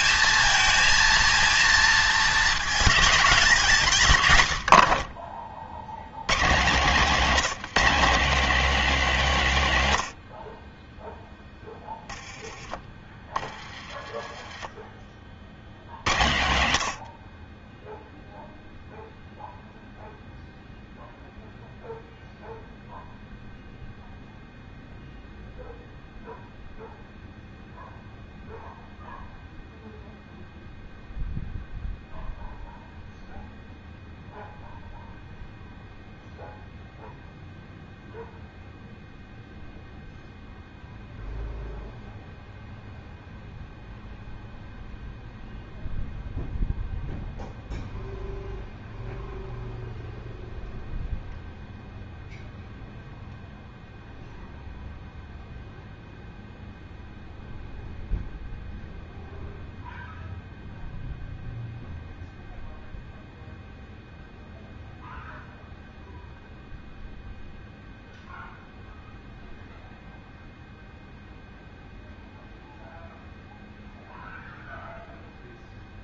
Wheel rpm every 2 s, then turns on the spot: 220, 220, 90, 140, 220, 40, 20, 20, 80, 0, 0, 0, 0, 0, 0, 0, 0, 0, 0, 0, 0, 0, 0, 0, 0, 0, 0, 0, 0, 0, 0, 0, 0, 0, 0, 0, 0, 0.
none